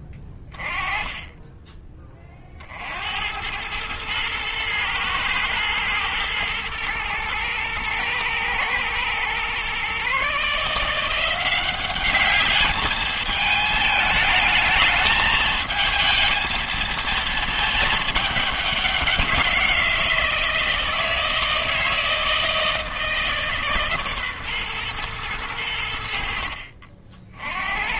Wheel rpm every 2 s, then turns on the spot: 20, 50, 110, 120, 120, 160, 210, 220, 220, 200, 160, 160, 130, 50.
none